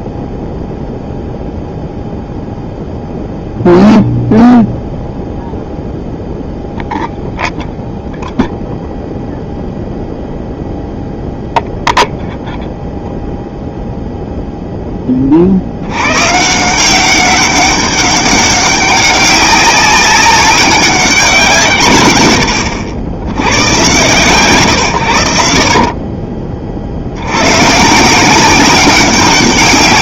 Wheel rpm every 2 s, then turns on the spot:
0, 0, 0, 0, 0, 0, 0, 0, 150, 190, 200, 90, 120, 40, 180.
none